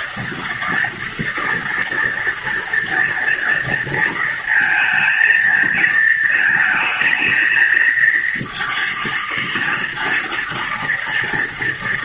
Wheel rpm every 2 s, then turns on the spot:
230, 240, 230, 220, 230, 230.
none